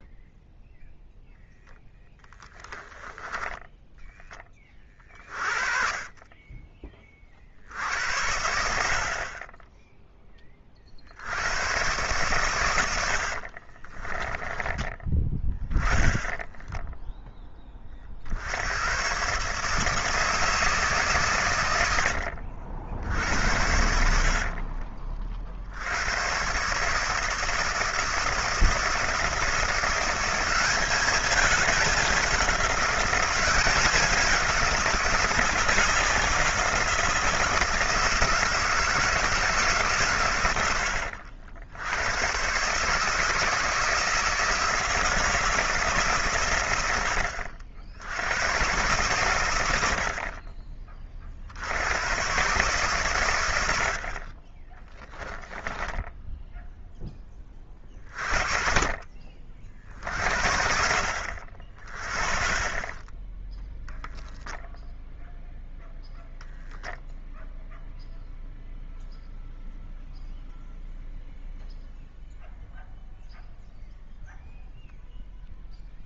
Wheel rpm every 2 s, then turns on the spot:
0, 10, 30, 20, 60, 60, 90, 10, 0, 110, 140, 70, 40, 140, 160, 200, 190, 190, 170, 160, 90, 140, 160, 80, 110, 40, 130, 10, 10, 40, 60, 20, 0, 0, 0, 0, 0, 0.
2-4 24-26 54-56